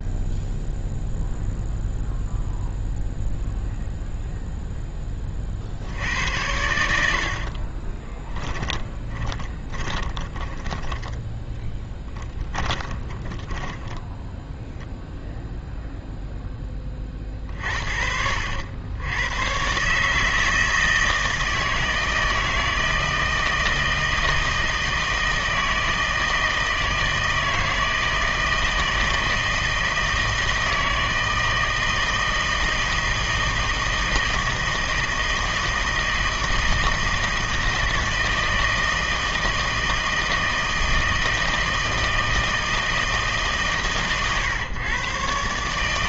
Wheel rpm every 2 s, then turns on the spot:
0, 0, 0, 80, 20, 20, 20, 0, 10, 80, 160, 160, 160, 160, 160, 160, 160, 160, 160, 160, 160, 160, 130.
8-14